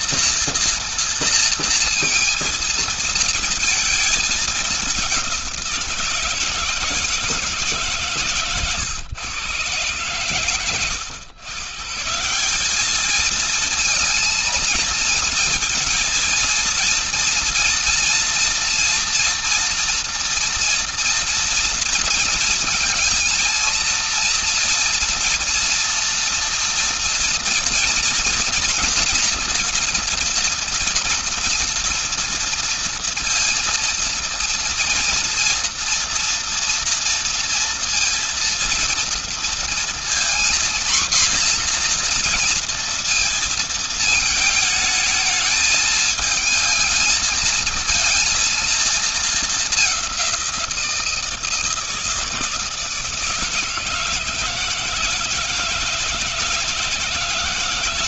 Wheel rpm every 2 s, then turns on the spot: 230, 230, 200, 160, 120, 100, 210, 220, 230, 230, 230, 230, 240, 230, 230, 230, 230, 230, 230, 230, 240, 230, 220, 220, 230, 170, 150, 160, 170.
none